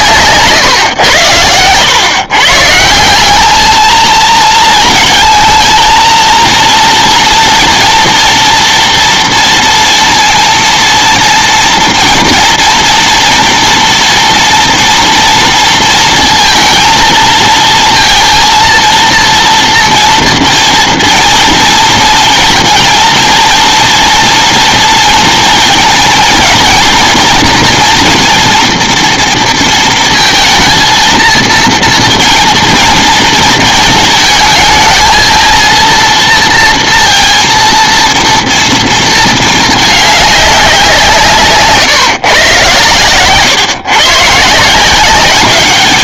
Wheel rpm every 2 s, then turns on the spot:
140, 150, 220, 230, 230, 230, 230, 230, 230, 230, 230, 230, 230, 230, 240, 230, 230, 220, 230, 230, 190, 130, 160.
0-2